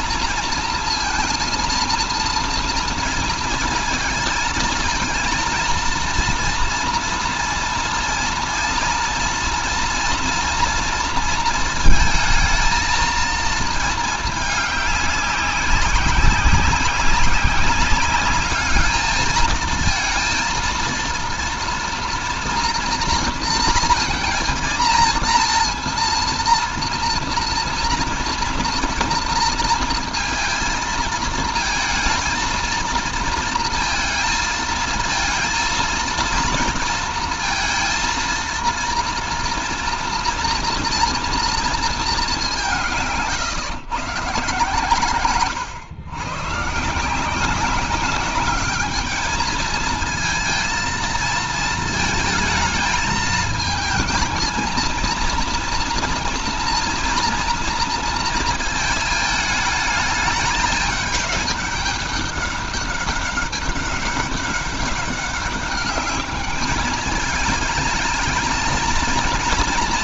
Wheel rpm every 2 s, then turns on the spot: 230, 230, 230, 230, 230, 230, 220, 210, 190, 210, 230, 230, 230, 230, 230, 230, 230, 220, 230, 230, 240, 180, 130, 140, 210, 230, 220, 230, 230, 220, 210, 200, 200, 210, 220.
none